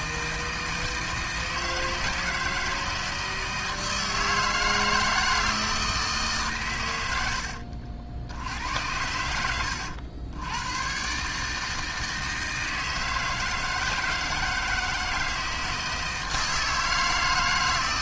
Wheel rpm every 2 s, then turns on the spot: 160, 160, 160, 110, 90, 110, 160, 160, 160.
none